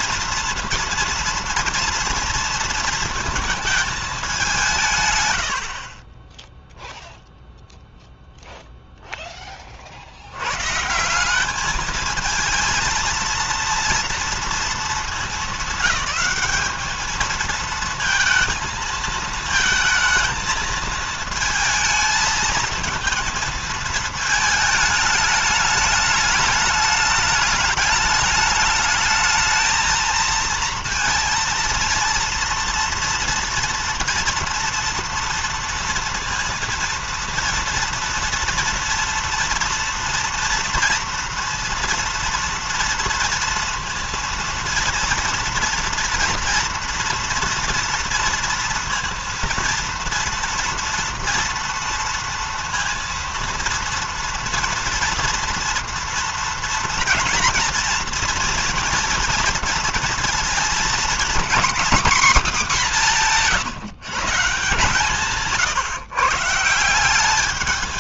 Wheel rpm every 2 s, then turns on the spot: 230, 230, 170, 0, 0, 110, 220, 230, 210, 220, 220, 230, 220, 210, 220, 230, 230, 230, 230, 230, 230, 230, 230, 240, 230, 230, 230, 230, 230, 230, 230, 230, 160, 160.
none